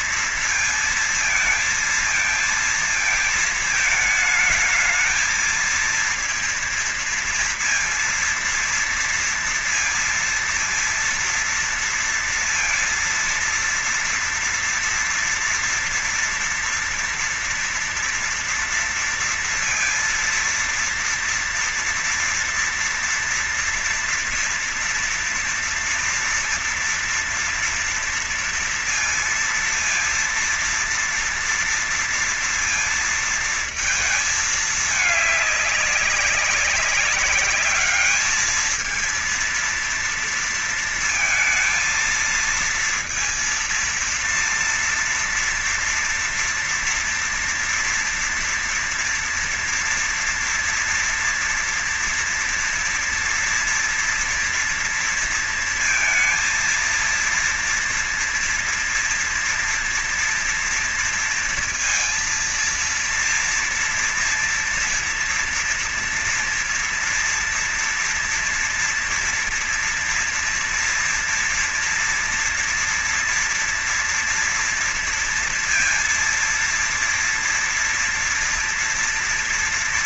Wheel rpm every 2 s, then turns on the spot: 230, 230, 220, 230, 230, 230, 230, 230, 230, 240, 230, 230, 230, 230, 230, 230, 230, 220, 200, 220, 230, 230, 230, 230, 230, 240, 230, 230, 230, 230, 230, 230, 230, 240, 240, 240, 230, 230, 230, 240.
none